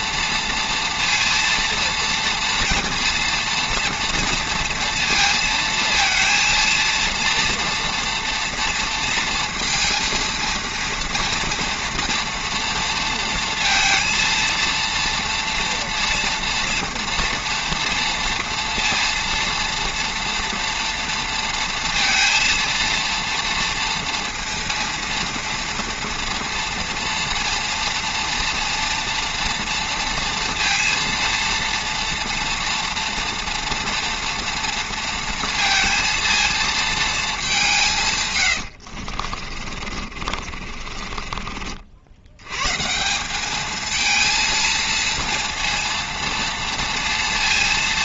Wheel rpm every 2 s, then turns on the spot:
230, 230, 230, 230, 230, 230, 230, 230, 230, 230, 230, 230, 230, 230, 240, 230, 230, 230, 220, 50, 40, 180, 230, 230.
38-42